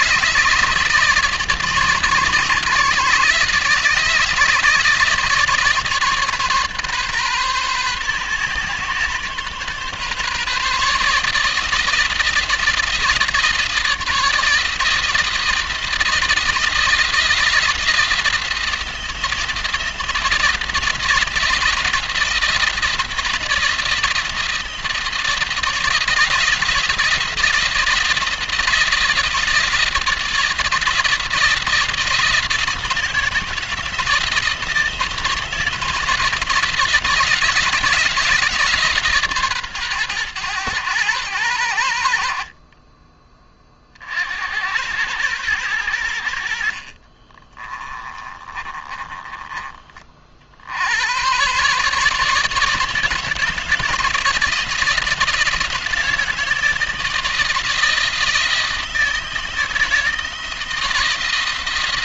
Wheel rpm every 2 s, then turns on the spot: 150, 150, 160, 140, 130, 150, 160, 160, 160, 160, 160, 170, 170, 170, 160, 160, 160, 160, 160, 150, 110, 30, 100, 50, 20, 80, 160, 160, 160, 160, 160.
46-50